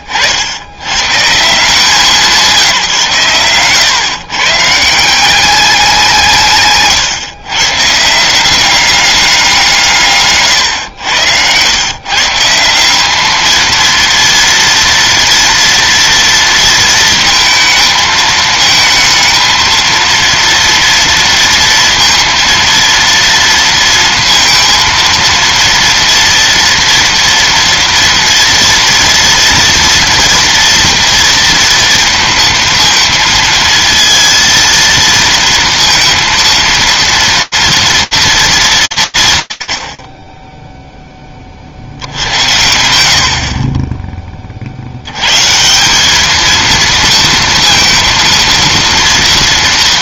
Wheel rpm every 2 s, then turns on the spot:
100, 170, 150, 140, 190, 120, 170, 230, 230, 220, 230, 230, 230, 240, 240, 230, 230, 230, 230, 200, 10, 80, 60, 230, 230.
42-44